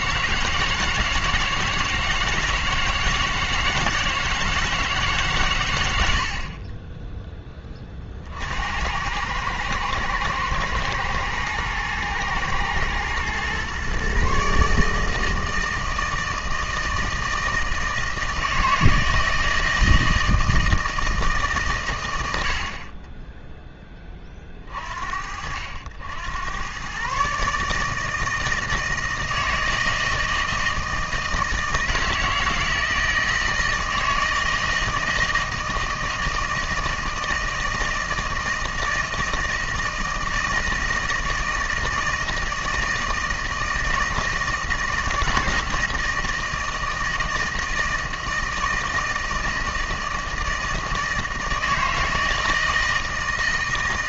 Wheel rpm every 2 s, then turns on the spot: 160, 160, 160, 30, 70, 120, 110, 140, 160, 160, 160, 70, 30, 100, 160, 160, 160, 160, 160, 160, 160, 160, 160, 160, 160, 160, 160.
6-8